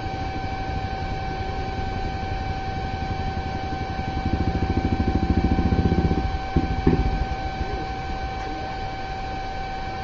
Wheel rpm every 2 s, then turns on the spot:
0, 0, 0, 0, 0.
none